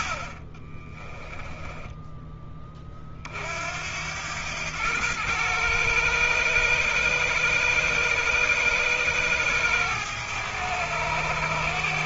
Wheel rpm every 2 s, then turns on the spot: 20, 50, 110, 110, 110, 110.
0-2